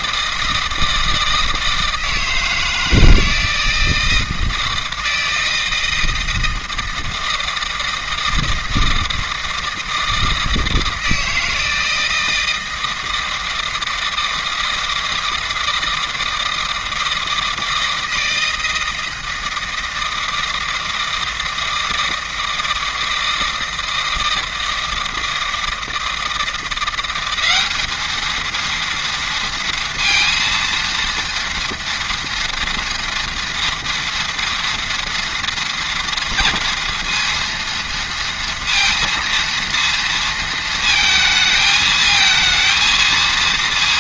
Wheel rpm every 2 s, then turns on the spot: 160, 160, 160, 160, 160, 160, 160, 160, 160, 160, 160, 160, 160, 170, 230, 230, 230, 230, 230, 230, 230, 220.
none